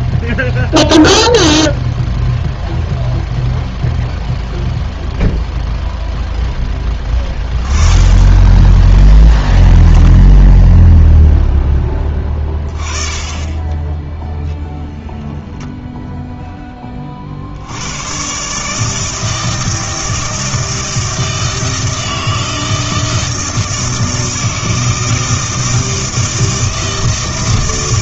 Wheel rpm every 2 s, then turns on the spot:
0, 0, 0, 10, 10, 0, 30, 0, 10, 150, 160, 160, 160, 160.
none